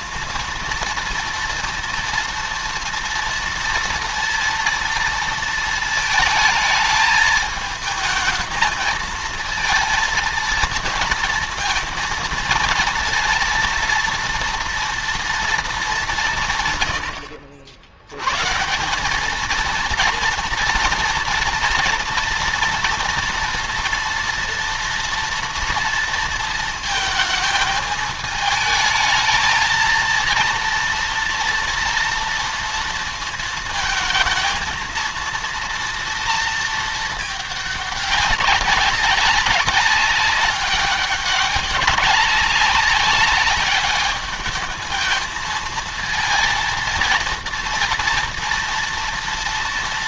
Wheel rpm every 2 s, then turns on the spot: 230, 230, 230, 220, 220, 230, 230, 230, 150, 130, 230, 230, 230, 230, 220, 230, 230, 220, 230, 200, 200, 190, 210, 230, 230.
none